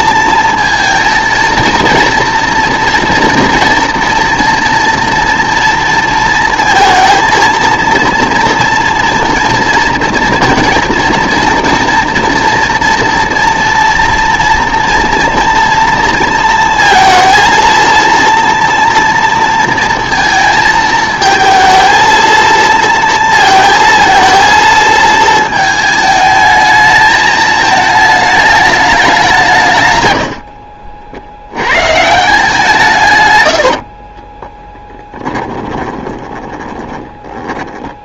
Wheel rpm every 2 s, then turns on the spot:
220, 230, 230, 230, 230, 230, 230, 230, 230, 240, 220, 230, 230, 220, 210, 50, 160, 10, 20.
30-32 34-38